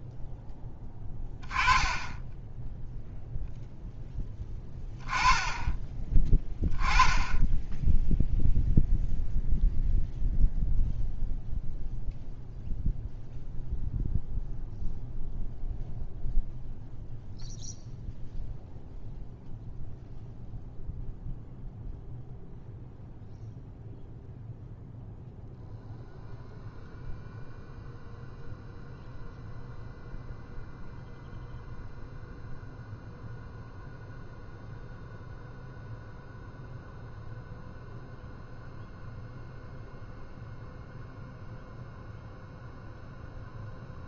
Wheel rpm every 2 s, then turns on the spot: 10, 0, 10, 10, 0, 0, 0, 0, 0, 0, 0, 0, 0, 0, 0, 0, 0, 0, 0, 0, 0, 0.
none